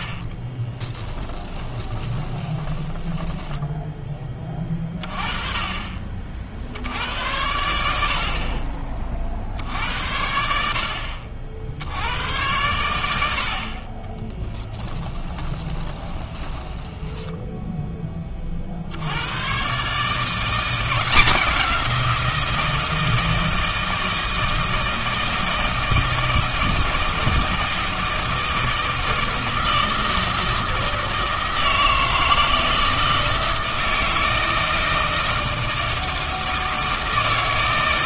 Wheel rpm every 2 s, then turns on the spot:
20, 20, 30, 70, 40, 70, 90, 10, 10, 60, 170, 160, 160, 160, 160, 160, 160, 160, 160.
0-4 14-18